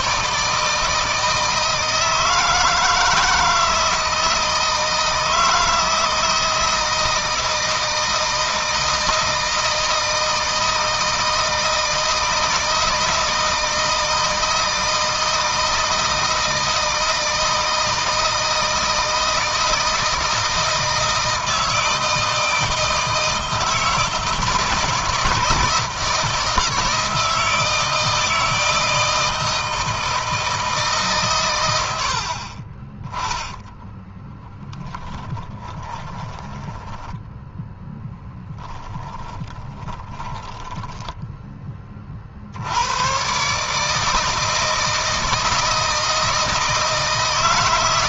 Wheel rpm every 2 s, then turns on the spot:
160, 160, 160, 170, 160, 160, 160, 160, 160, 160, 160, 160, 160, 160, 160, 150, 20, 10, 10, 20, 10, 100, 160, 160.
34-42